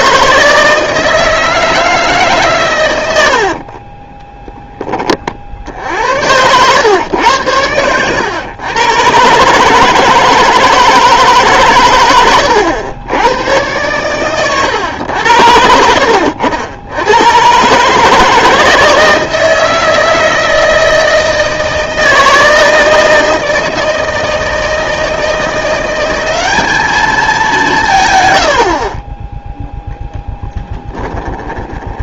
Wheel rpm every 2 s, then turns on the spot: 160, 120, 10, 110, 120, 160, 100, 110, 80, 160, 160, 160, 160, 210, 60, 20.
30-32